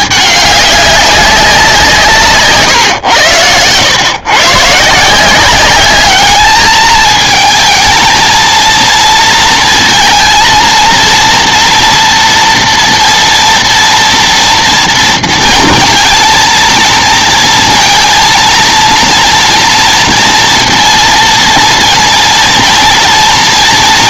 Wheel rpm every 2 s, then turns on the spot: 200, 140, 140, 210, 220, 230, 230, 230, 230, 230, 230, 230.
none